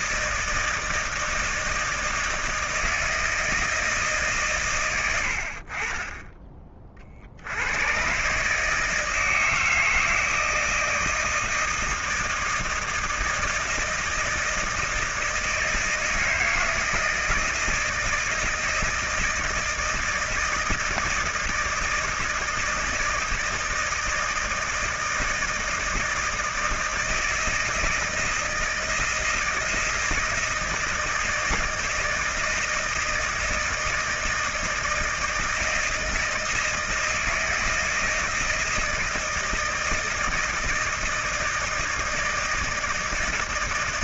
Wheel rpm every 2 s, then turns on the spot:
160, 160, 130, 30, 150, 160, 160, 160, 160, 160, 160, 160, 160, 160, 160, 160, 160, 160, 160, 160, 160, 160.
none